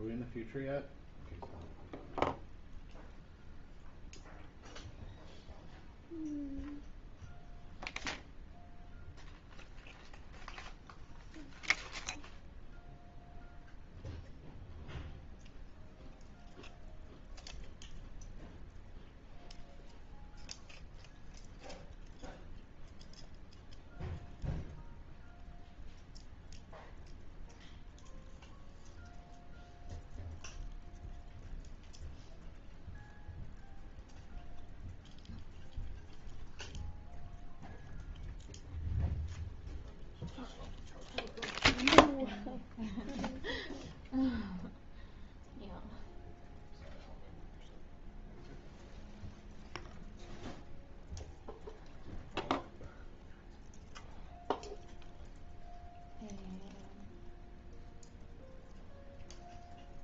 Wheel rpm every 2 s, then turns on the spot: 0, 0, 0, 0, 0, 0, 0, 0, 0, 0, 0, 0, 0, 0, 0, 0, 0, 0, 0, 0, 0, 0, 0, 0, 0, 0, 0, 0, 0, 0.
none